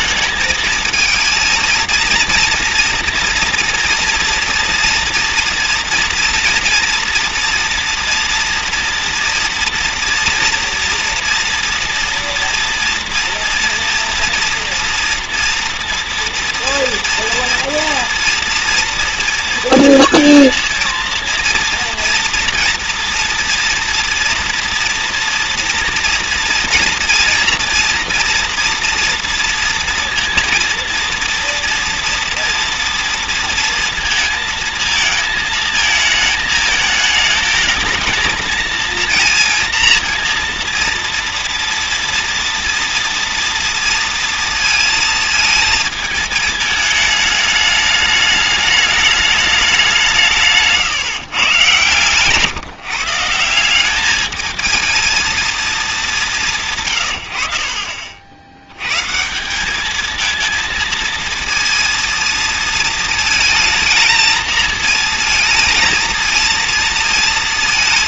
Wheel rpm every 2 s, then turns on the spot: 220, 230, 230, 230, 240, 230, 230, 230, 230, 230, 230, 230, 230, 230, 230, 230, 230, 230, 210, 220, 230, 230, 230, 210, 210, 150, 150, 220, 140, 100, 230, 230, 220, 230.
50-52